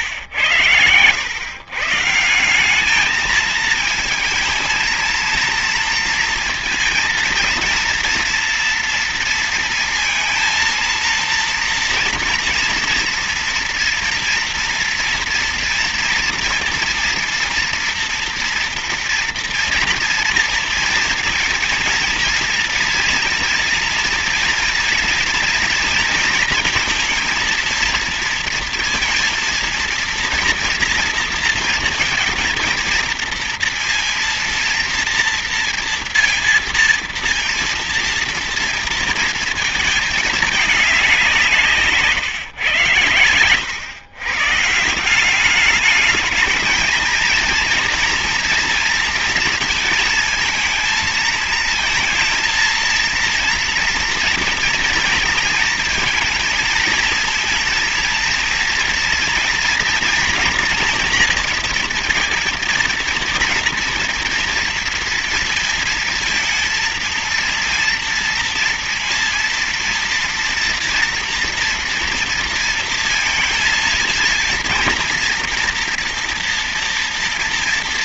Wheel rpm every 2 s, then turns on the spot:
100, 190, 220, 230, 230, 230, 230, 230, 230, 230, 230, 230, 230, 230, 230, 230, 230, 230, 230, 230, 210, 140, 150, 220, 230, 220, 230, 230, 220, 230, 230, 230, 230, 230, 230, 230, 230, 230, 230.
none